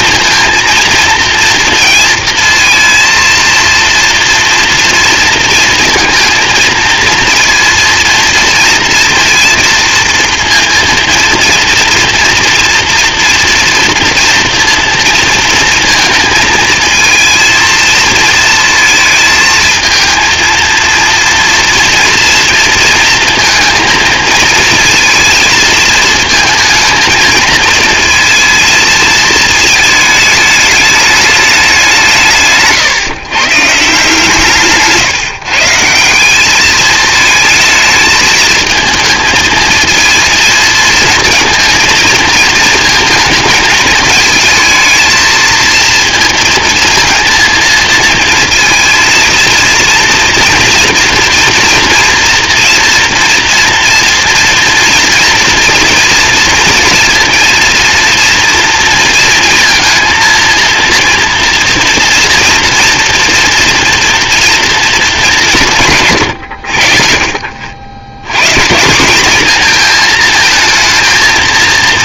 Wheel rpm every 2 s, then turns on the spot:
230, 230, 230, 230, 230, 230, 230, 230, 220, 230, 230, 230, 230, 230, 220, 210, 140, 160, 210, 220, 230, 220, 220, 220, 230, 230, 230, 230, 230, 230, 230, 230, 230, 90, 150, 230.
32-34